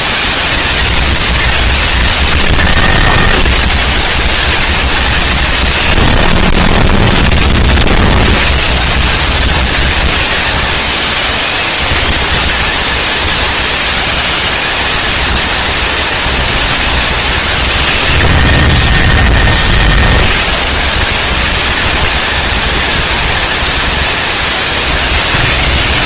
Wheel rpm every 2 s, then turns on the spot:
230, 130, 180, 40, 100, 230, 220, 220, 230, 40, 100, 230, 220.
none